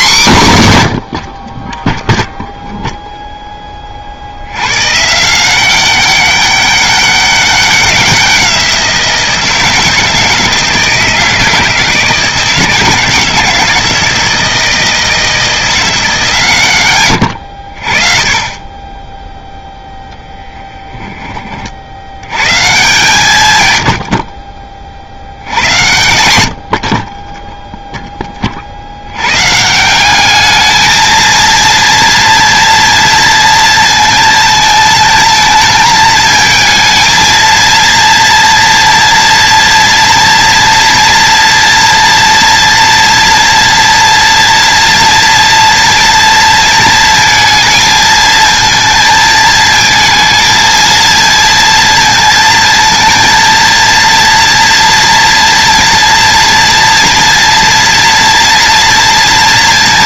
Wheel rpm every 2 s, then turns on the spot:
110, 0, 120, 200, 170, 160, 160, 160, 110, 20, 10, 150, 60, 50, 70, 220, 230, 220, 220, 230, 230, 230, 230, 230, 220, 230, 230, 230, 230, 230.
none